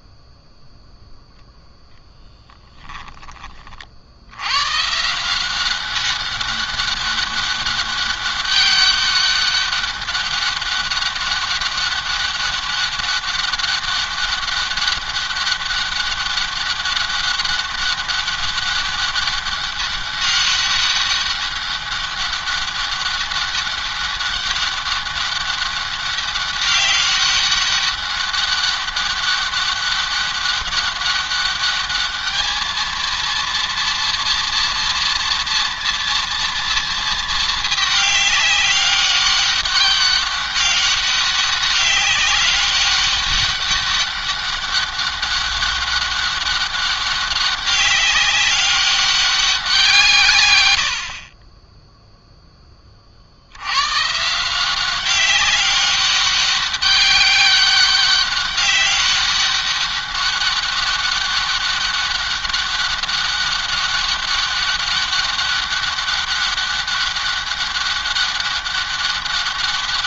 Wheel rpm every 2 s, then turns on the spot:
0, 20, 140, 200, 200, 200, 200, 200, 200, 200, 200, 200, 200, 200, 200, 200, 220, 230, 230, 200, 200, 200, 200, 200, 200, 80, 20, 180, 200, 200, 200, 200, 200, 200, 200.
none